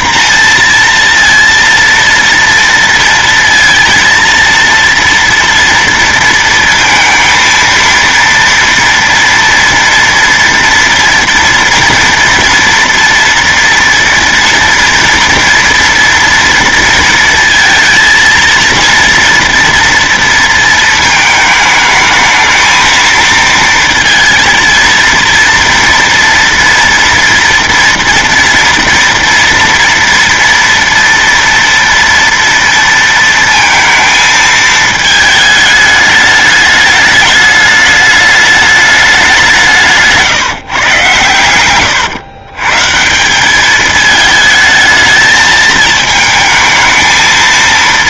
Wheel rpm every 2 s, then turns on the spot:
240, 230, 230, 230, 230, 230, 230, 230, 230, 230, 230, 220, 230, 230, 230, 230, 230, 220, 210, 210, 140, 130, 220, 220.
none